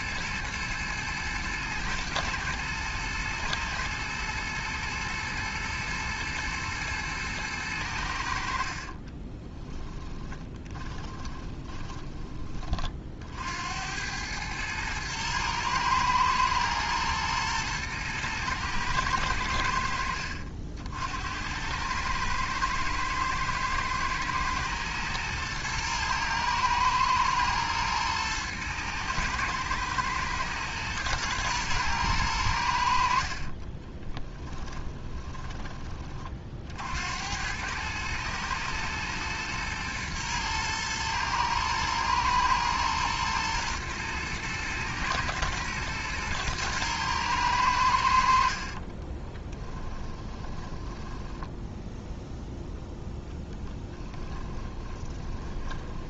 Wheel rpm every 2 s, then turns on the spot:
110, 120, 110, 110, 40, 20, 40, 110, 110, 110, 70, 110, 120, 110, 110, 110, 70, 10, 70, 120, 110, 110, 110, 110, 40, 10, 0, 20.
8-12 34-36 48-52 54-56